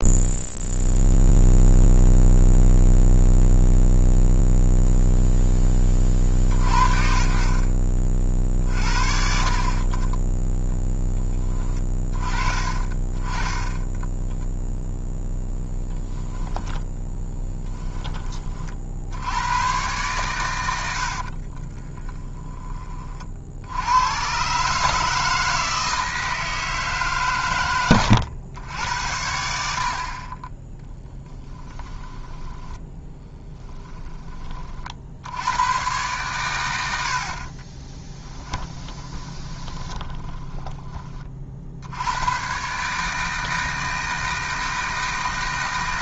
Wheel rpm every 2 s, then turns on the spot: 0, 0, 0, 40, 50, 10, 30, 0, 10, 50, 80, 30, 150, 150, 90, 10, 20, 50, 80, 20, 20, 130, 160.
16-18 32-34 38-42